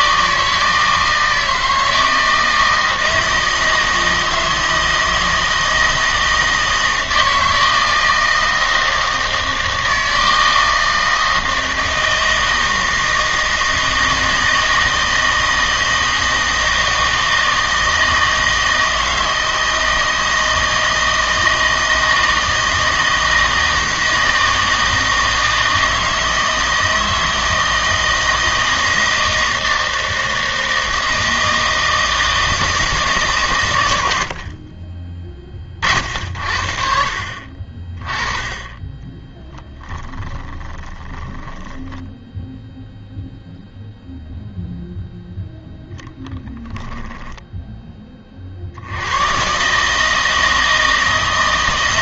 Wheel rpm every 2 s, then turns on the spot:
160, 160, 160, 160, 160, 160, 160, 160, 160, 160, 160, 160, 160, 160, 160, 160, 160, 40, 50, 20, 20, 0, 0, 10, 60, 160.
40-42